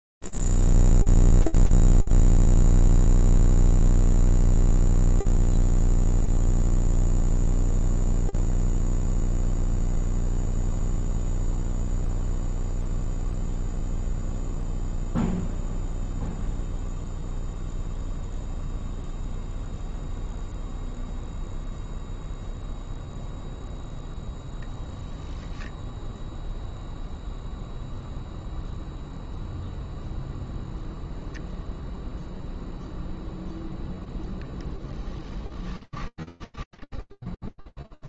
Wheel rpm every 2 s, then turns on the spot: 0, 0, 0, 0, 0, 0, 0, 0, 0, 0, 0, 0, 0, 0, 0, 0, 0, 10, 0.
34-36